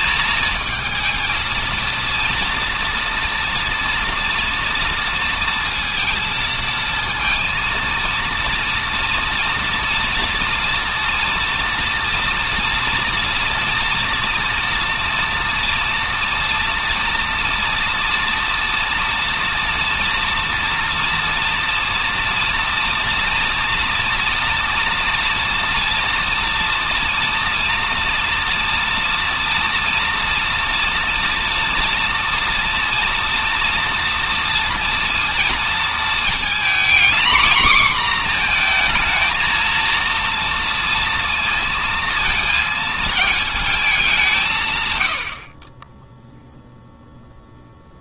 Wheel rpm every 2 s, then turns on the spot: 220, 230, 230, 230, 230, 230, 230, 230, 230, 230, 230, 230, 230, 240, 230, 230, 230, 230, 230, 240, 230, 230, 220, 40.
none